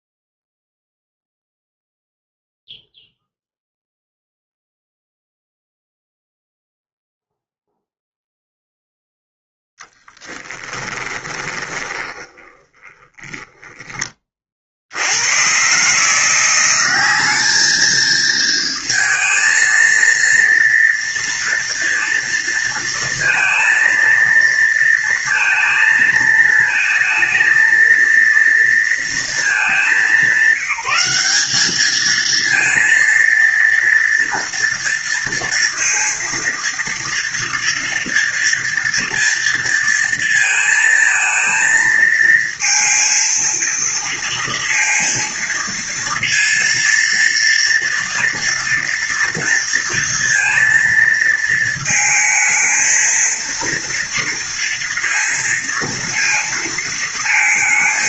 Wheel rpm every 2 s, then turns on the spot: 0, 0, 0, 0, 0, 10, 20, 60, 190, 230, 230, 230, 230, 220, 230, 190, 230, 230, 230, 230, 220, 230, 230, 240, 230, 230, 230, 230, 230.
10-14